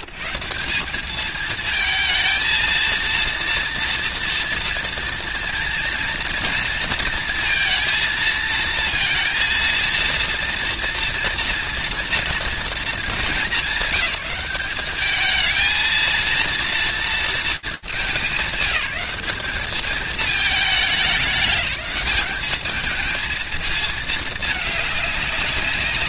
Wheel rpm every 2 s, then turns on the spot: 170, 220, 230, 230, 230, 230, 220, 200, 230, 190, 210, 210, 210.
none